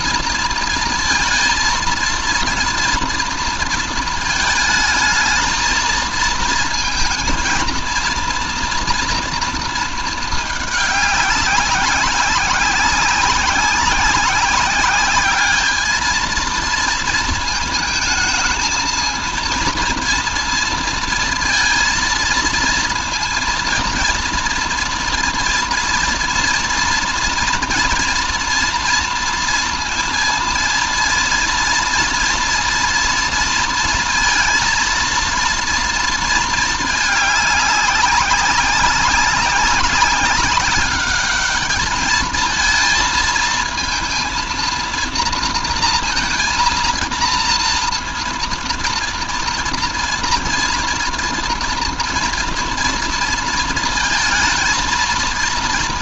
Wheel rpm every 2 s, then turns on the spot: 230, 230, 220, 230, 230, 210, 190, 190, 230, 220, 230, 230, 240, 230, 230, 230, 230, 220, 220, 190, 190, 220, 230, 230, 230, 230, 230, 220.
none